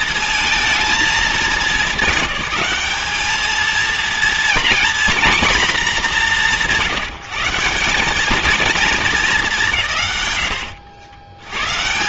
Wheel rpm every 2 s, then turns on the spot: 230, 210, 240, 180, 230, 90.
none